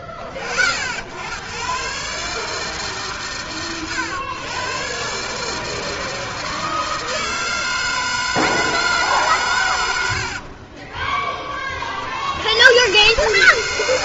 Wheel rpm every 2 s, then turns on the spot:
80, 130, 130, 160, 150, 30, 110.
10-12